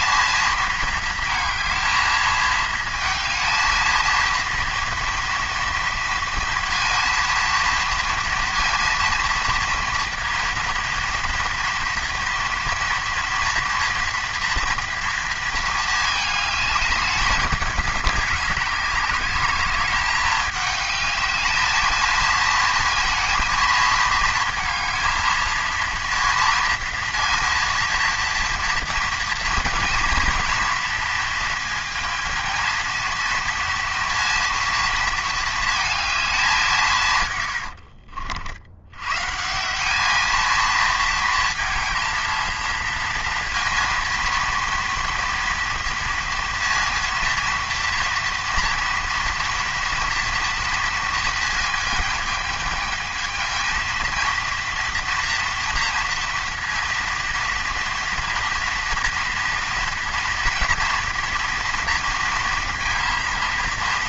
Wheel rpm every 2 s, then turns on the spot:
220, 220, 230, 230, 230, 230, 230, 230, 210, 200, 210, 230, 220, 230, 230, 230, 230, 230, 170, 100, 230, 230, 230, 230, 230, 230, 220, 230, 230, 240, 230, 230.
none